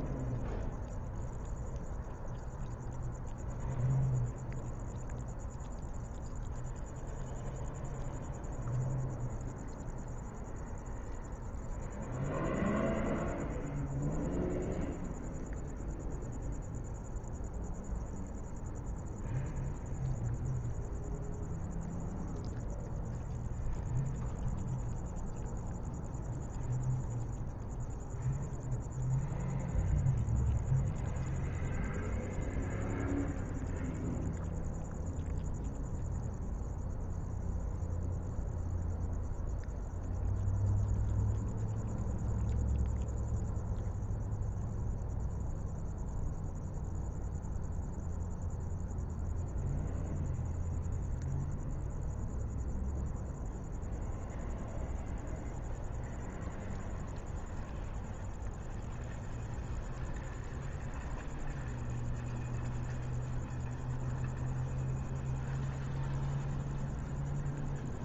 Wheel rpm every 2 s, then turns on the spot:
0, 0, 0, 0, 0, 0, 0, 0, 0, 0, 0, 0, 0, 0, 0, 0, 0, 0, 0, 0, 0, 0, 0, 0, 0, 0, 0, 0, 0, 0, 0, 0, 0, 0.
none